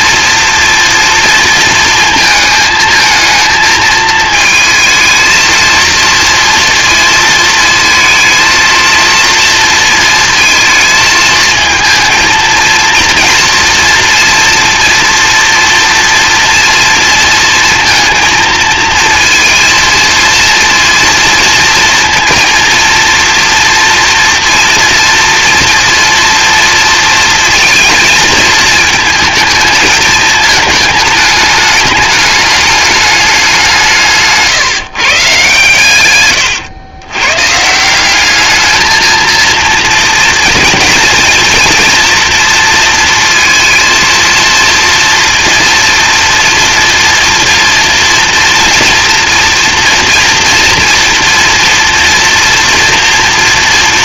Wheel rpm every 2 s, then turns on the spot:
230, 220, 220, 230, 230, 230, 230, 230, 230, 230, 230, 230, 230, 230, 220, 220, 210, 170, 120, 210, 230, 230, 230, 230, 230, 230, 230.
none